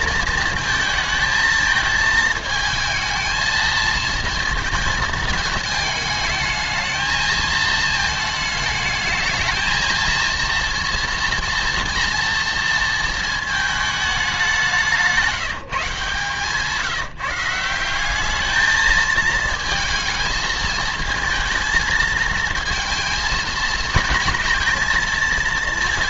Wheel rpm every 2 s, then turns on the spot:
220, 220, 230, 220, 220, 230, 230, 190, 160, 220, 220, 220, 220.
none